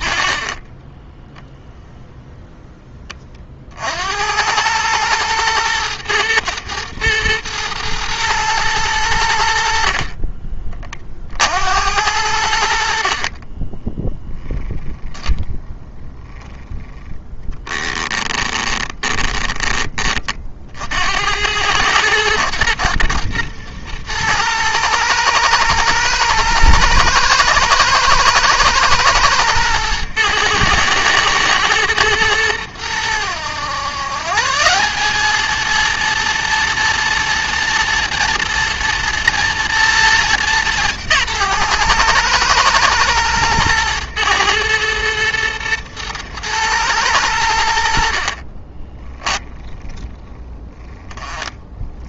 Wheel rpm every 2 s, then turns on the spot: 20, 20, 110, 120, 100, 30, 60, 10, 10, 20, 60, 120, 110, 110, 110, 110, 100, 190, 230, 230, 180, 110, 110, 110, 20, 10.
0-2 18-20 48-50